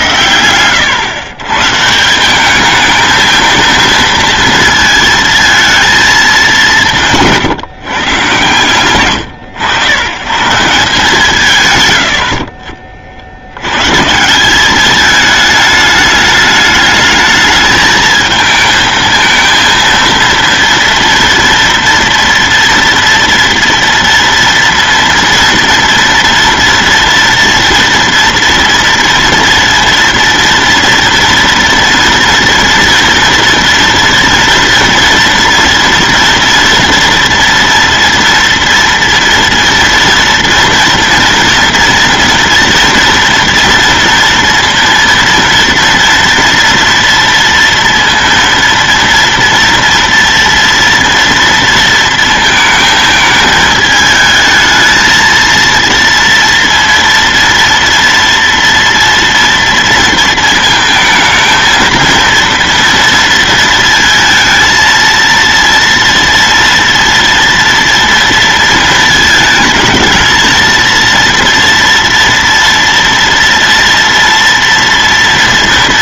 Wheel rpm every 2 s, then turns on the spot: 110, 200, 230, 190, 120, 160, 40, 200, 210, 220, 230, 240, 230, 230, 240, 230, 230, 230, 230, 240, 230, 230, 230, 230, 230, 230, 220, 220, 230, 230, 220, 230, 230, 230, 230, 230, 230, 230.
none